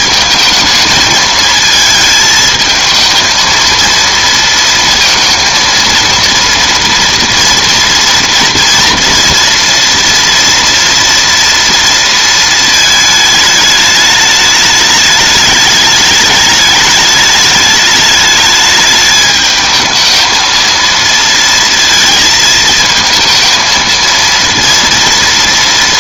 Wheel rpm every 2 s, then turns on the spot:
220, 220, 230, 230, 230, 230, 220, 210, 210, 210, 230, 230, 230.
none